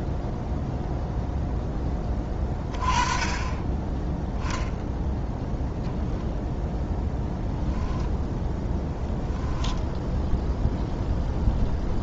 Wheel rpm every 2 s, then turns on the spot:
0, 30, 0, 0, 10, 0.
8-10